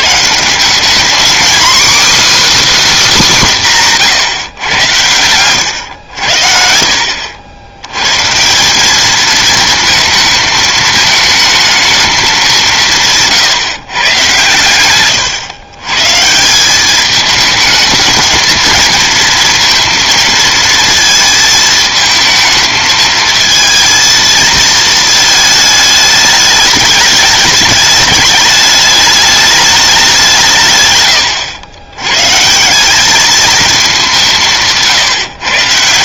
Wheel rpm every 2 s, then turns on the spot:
150, 310, 140, 80, 150, 220, 200, 110, 160, 220, 230, 220, 220, 210, 210, 170, 140, 170.
14-16